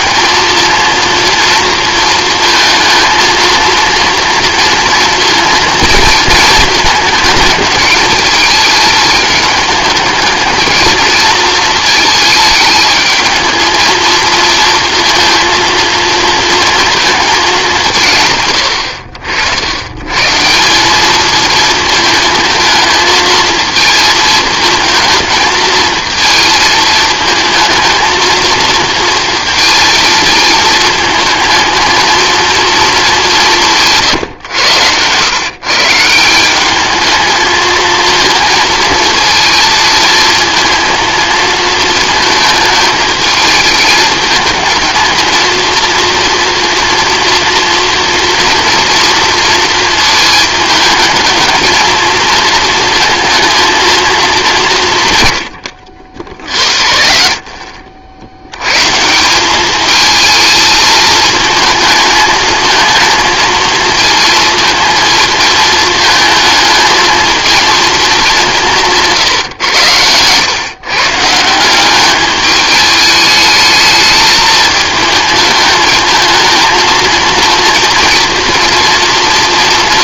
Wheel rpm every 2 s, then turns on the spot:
220, 230, 230, 230, 220, 220, 220, 230, 230, 100, 190, 220, 220, 220, 230, 230, 220, 110, 200, 230, 230, 220, 220, 240, 230, 220, 230, 170, 70, 120, 220, 220, 230, 220, 180, 130, 210, 220, 230, 230.
none